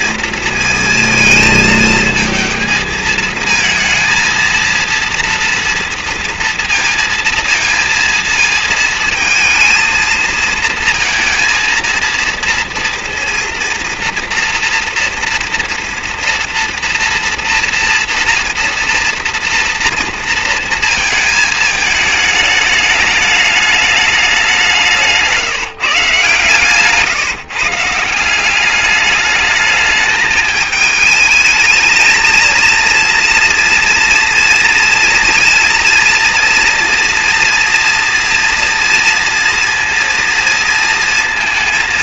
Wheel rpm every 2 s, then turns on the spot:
230, 230, 230, 230, 230, 230, 230, 230, 230, 230, 230, 220, 200, 140, 170, 210, 230, 230, 230, 230, 230.
none